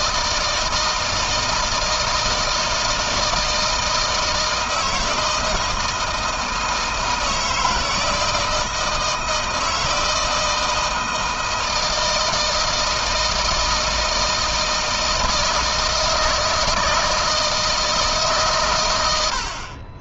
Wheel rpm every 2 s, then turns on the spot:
160, 160, 160, 160, 160, 160, 160, 160, 160, 90.
none